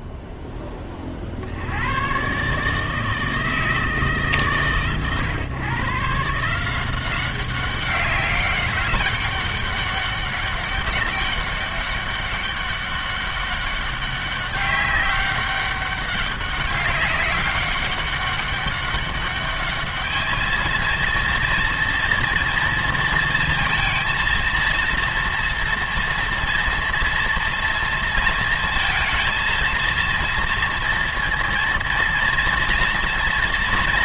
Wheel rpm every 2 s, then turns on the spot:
20, 150, 120, 180, 190, 200, 200, 200, 190, 200, 230, 230, 230, 230, 230, 230, 230.
none